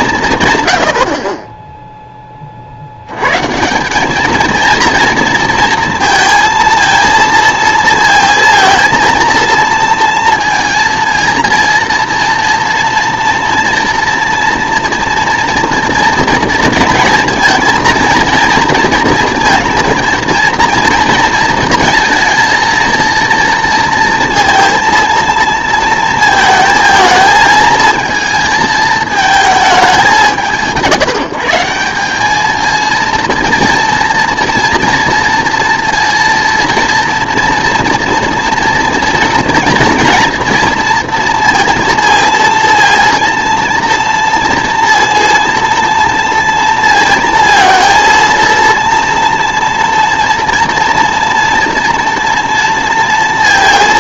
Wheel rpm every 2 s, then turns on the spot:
100, 60, 230, 230, 230, 220, 230, 230, 230, 230, 230, 230, 230, 220, 220, 180, 220, 230, 230, 230, 230, 230, 230, 230, 230, 240, 230.
none